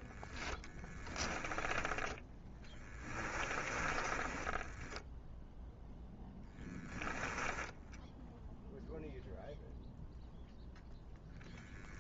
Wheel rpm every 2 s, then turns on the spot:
10, 20, 0, 10, 0, 0.
2-4